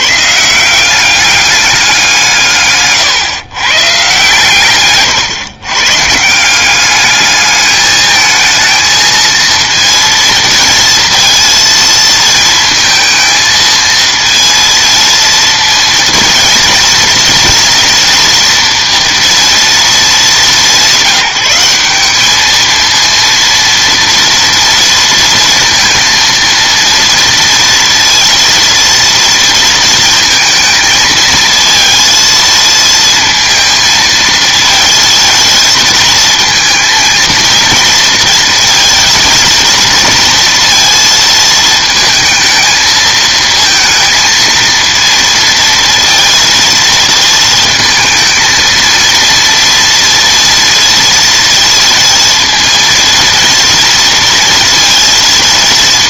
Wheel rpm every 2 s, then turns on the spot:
170, 140, 130, 190, 220, 230, 220, 230, 230, 240, 190, 220, 230, 230, 230, 220, 220, 230, 230, 220, 230, 220, 230, 230, 230, 230, 230, 230.
none